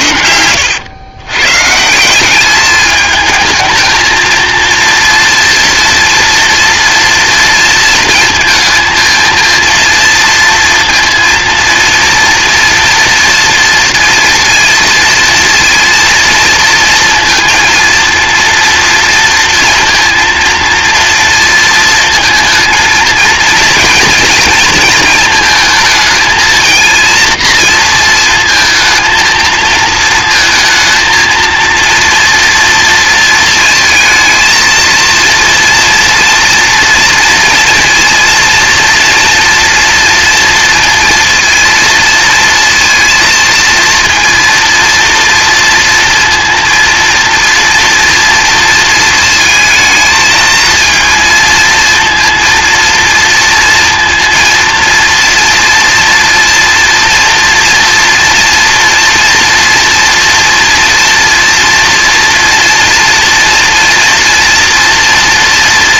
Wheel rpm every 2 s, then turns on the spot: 110, 210, 230, 230, 230, 230, 230, 230, 230, 230, 230, 230, 230, 230, 220, 220, 230, 220, 230, 230, 230, 230, 230, 230, 230, 230, 230, 230, 230, 230, 230, 230, 230.
none